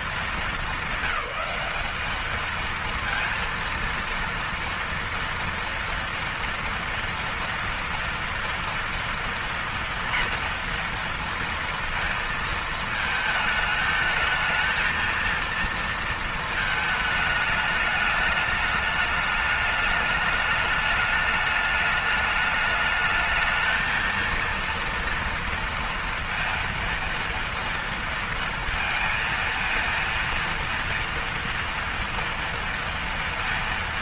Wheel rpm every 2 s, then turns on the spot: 230, 220, 230, 230, 230, 230, 230, 220, 230, 210, 210, 210, 220, 230, 230, 230, 230.
none